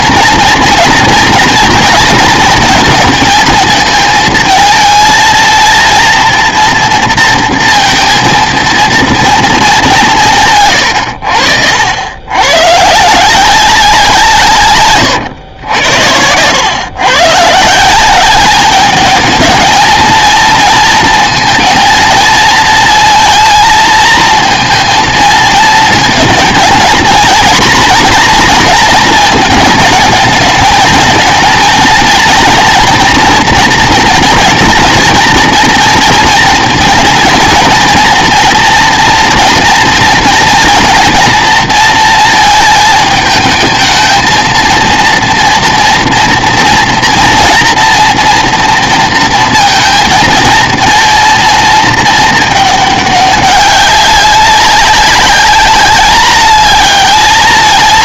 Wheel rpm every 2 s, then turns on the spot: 230, 220, 220, 240, 230, 120, 140, 140, 110, 210, 230, 220, 230, 230, 230, 220, 230, 230, 230, 240, 230, 220, 230, 230, 230, 230, 210, 190, 210.
none